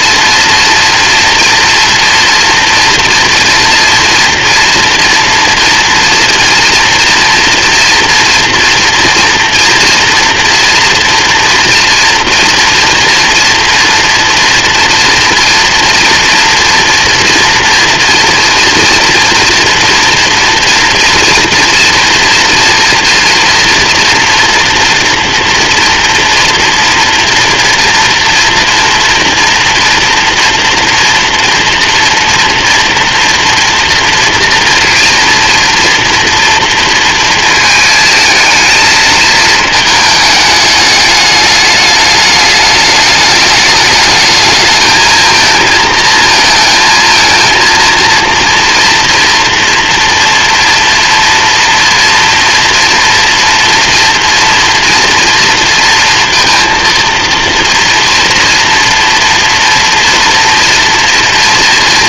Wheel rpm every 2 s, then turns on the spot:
230, 240, 230, 240, 230, 240, 230, 240, 230, 230, 230, 230, 240, 230, 240, 230, 240, 230, 230, 220, 210, 210, 220, 220, 230, 240, 230, 240, 230, 240, 240.
none